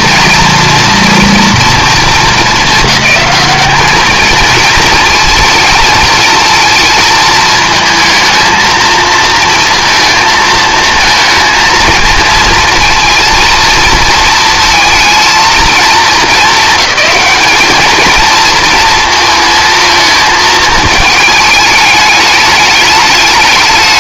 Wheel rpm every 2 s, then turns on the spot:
240, 210, 220, 230, 220, 230, 230, 230, 200, 230, 220, 210.
none